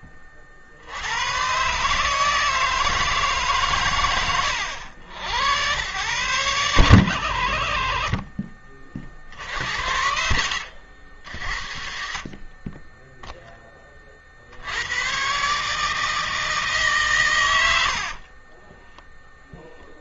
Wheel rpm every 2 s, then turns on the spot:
30, 150, 100, 110, 30, 80, 30, 60, 160, 40.
12-14 18-20